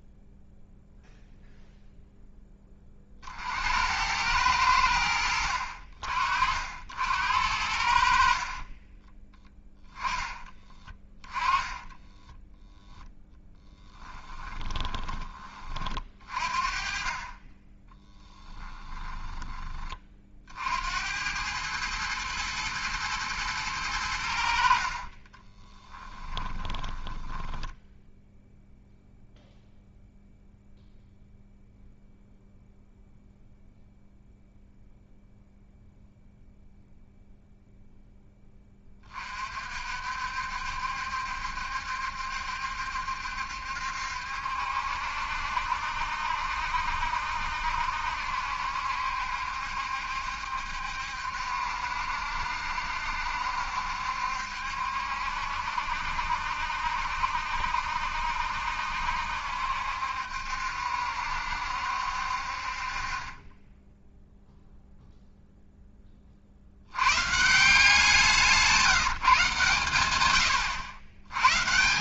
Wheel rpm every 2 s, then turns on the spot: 0, 30, 90, 70, 30, 10, 0, 20, 40, 20, 60, 110, 60, 10, 0, 0, 0, 0, 0, 20, 70, 70, 70, 70, 70, 70, 70, 70, 70, 70, 70, 40, 0, 70, 170, 90.
10-12 14-16 18-20 24-28